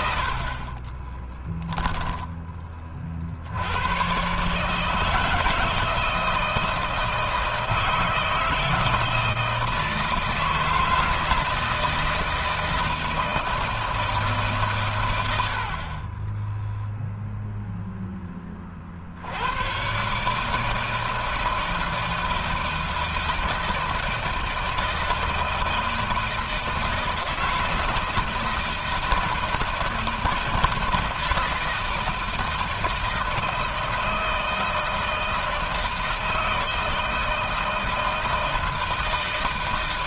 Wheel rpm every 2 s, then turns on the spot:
20, 20, 150, 160, 160, 160, 160, 120, 0, 50, 160, 160, 160, 160, 160, 160, 160, 160, 160, 160.
none